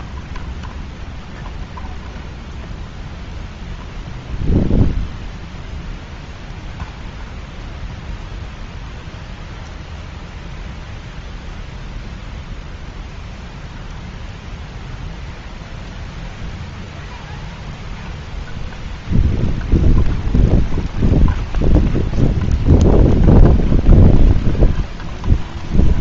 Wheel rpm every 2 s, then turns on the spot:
0, 0, 0, 0, 0, 0, 0, 0, 0, 0, 0, 0, 0.
none